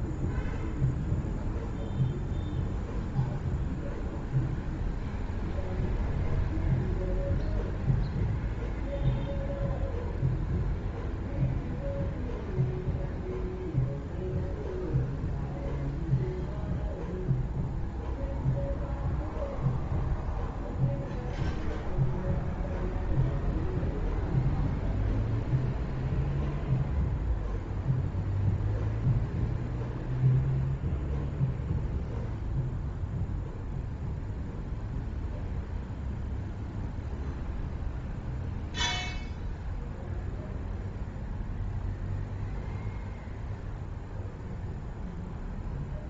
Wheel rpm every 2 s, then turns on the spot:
0, 0, 0, 0, 0, 0, 0, 0, 0, 0, 0, 0, 0, 0, 0, 0, 0, 0, 0, 0, 0, 0, 0.
none